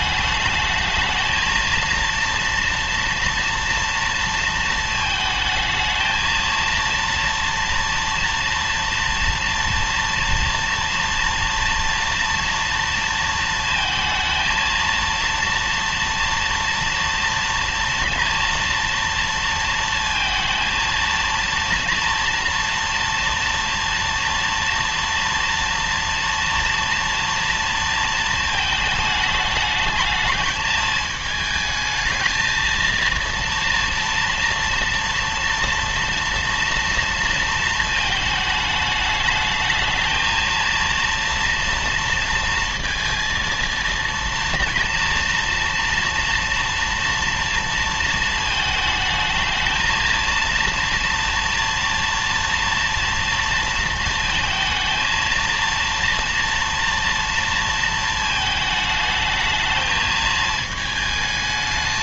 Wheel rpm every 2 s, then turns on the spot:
220, 230, 220, 230, 230, 230, 230, 230, 230, 230, 230, 230, 230, 230, 220, 220, 230, 230, 230, 210, 230, 230, 230, 230, 220, 230, 230, 230, 230, 220, 220.
none